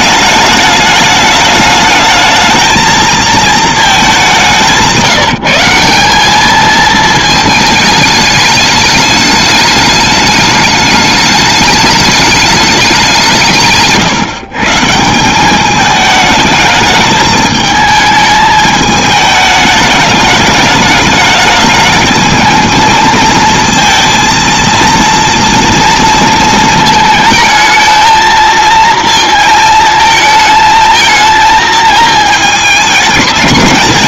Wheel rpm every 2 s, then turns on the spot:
210, 220, 180, 210, 210, 210, 210, 140, 210, 220, 210, 220, 230, 220, 220, 220, 220.
none